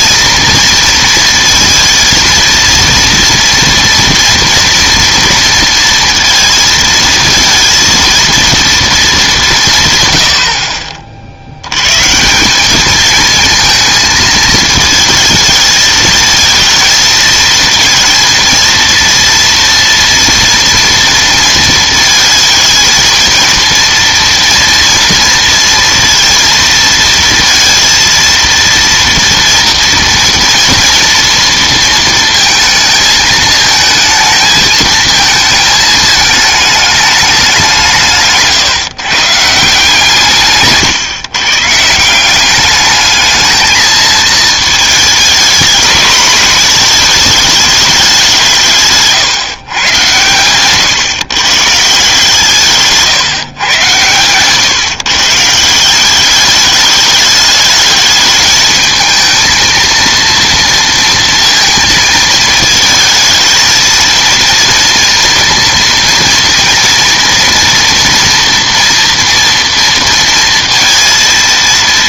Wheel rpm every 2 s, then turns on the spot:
230, 230, 230, 230, 230, 60, 190, 220, 230, 230, 230, 220, 230, 230, 230, 230, 220, 220, 210, 140, 150, 190, 220, 220, 180, 120, 160, 130, 200, 220, 230, 220, 230, 230, 240, 230.
none